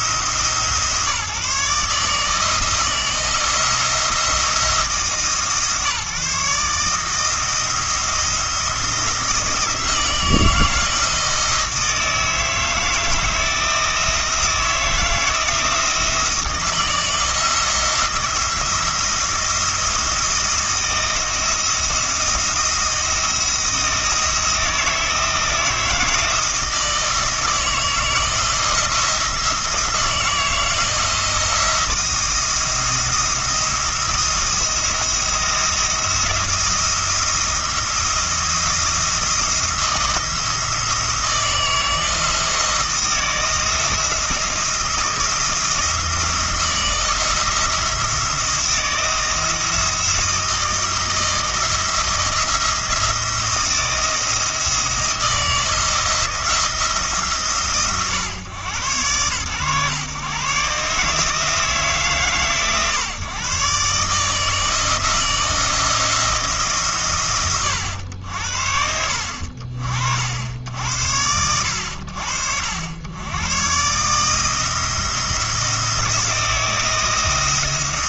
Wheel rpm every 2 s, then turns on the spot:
150, 160, 150, 150, 170, 160, 160, 160, 170, 170, 170, 170, 160, 160, 170, 160, 170, 170, 170, 170, 170, 170, 170, 160, 170, 160, 170, 170, 160, 110, 160, 130, 160, 120, 70, 100, 90, 160, 170.
none